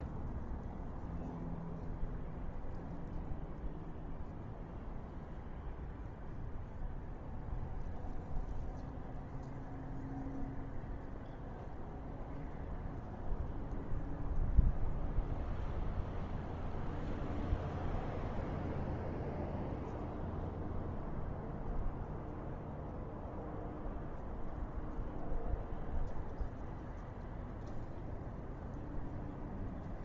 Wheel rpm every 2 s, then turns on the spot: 0, 0, 0, 0, 0, 0, 0, 0, 0, 0, 0, 0, 0, 0, 0.
none